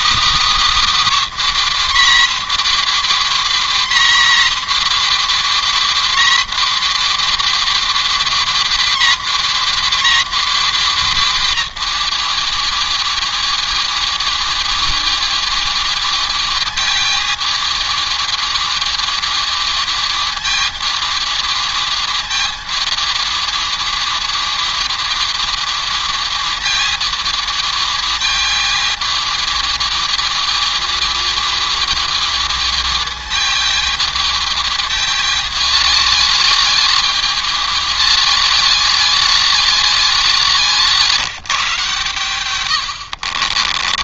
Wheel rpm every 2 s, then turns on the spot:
320, 280, 270, 270, 270, 270, 230, 220, 220, 220, 220, 220, 220, 220, 220, 220, 220, 220, 220, 220, 190, 120.
none